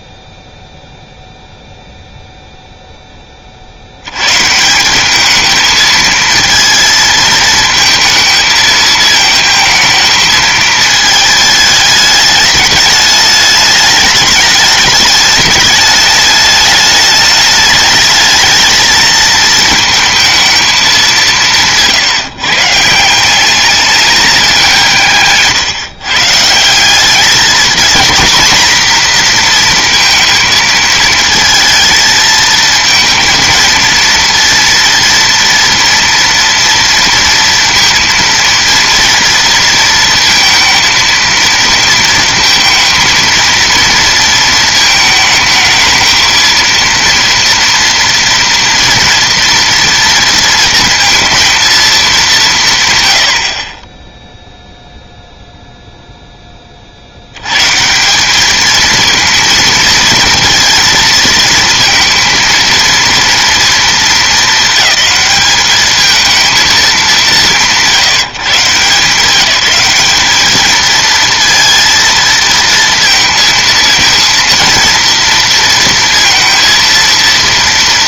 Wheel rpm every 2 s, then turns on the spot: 0, 0, 160, 230, 220, 220, 210, 210, 210, 220, 220, 160, 180, 170, 240, 220, 220, 230, 230, 230, 220, 230, 220, 230, 230, 230, 140, 0, 30, 220, 230, 230, 210, 210, 160, 220, 230, 230, 230.
none